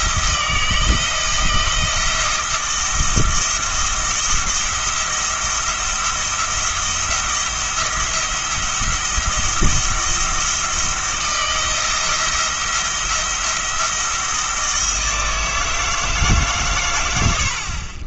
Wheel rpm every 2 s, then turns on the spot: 160, 160, 170, 170, 170, 170, 170, 160, 120.
none